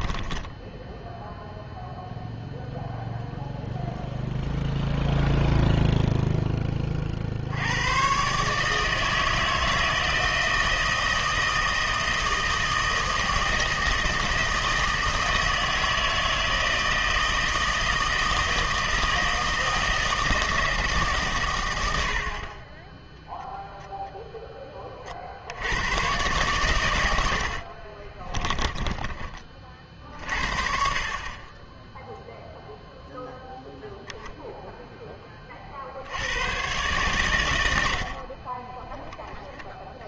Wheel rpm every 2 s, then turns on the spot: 10, 0, 0, 20, 150, 160, 160, 160, 160, 160, 160, 20, 10, 110, 20, 50, 0, 10, 120, 10.
0-2 28-30